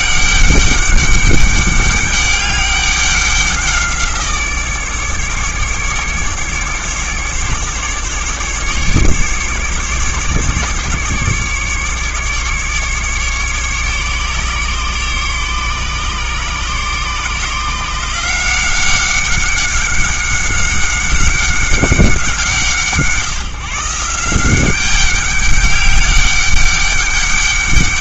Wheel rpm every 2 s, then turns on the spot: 200, 200, 160, 150, 150, 140, 140, 140, 140, 180, 190, 160, 190, 200.
none